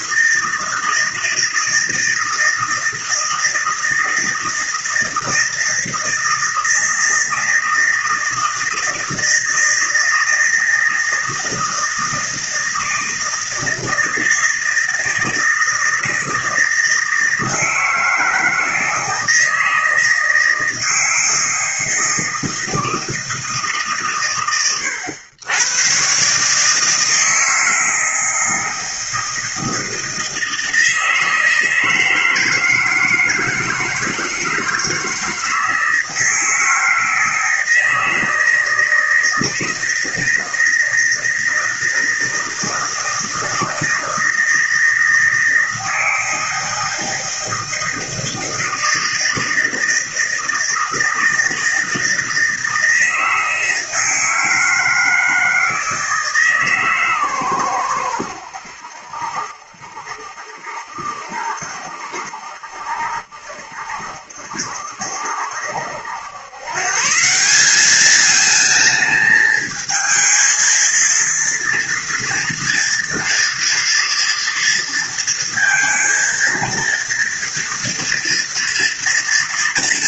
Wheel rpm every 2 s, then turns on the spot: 160, 160, 160, 160, 160, 160, 160, 160, 160, 160, 160, 160, 110, 140, 160, 160, 160, 160, 160, 160, 160, 160, 160, 160, 160, 160, 160, 160, 150, 90, 70, 70, 70, 140, 220, 220, 240, 230, 230, 240.
none